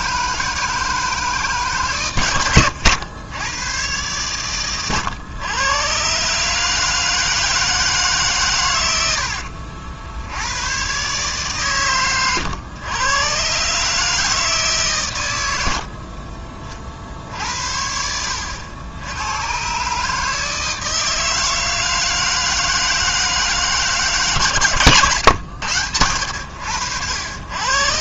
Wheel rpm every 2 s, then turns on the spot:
160, 100, 110, 160, 100, 120, 110, 130, 60, 90, 160, 160, 130, 80.
none